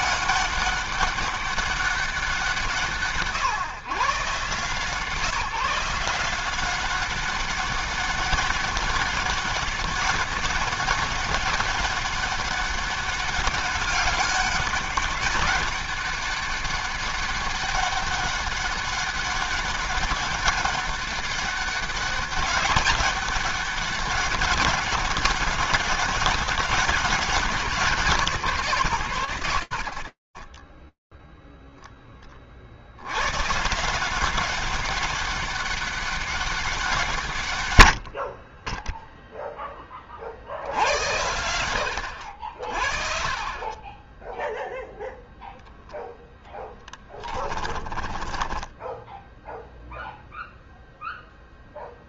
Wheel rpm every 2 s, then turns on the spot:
200, 170, 150, 190, 200, 200, 200, 200, 200, 200, 200, 200, 200, 200, 130, 10, 150, 200, 80, 10, 80, 30, 0, 20, 10, 10.
46-48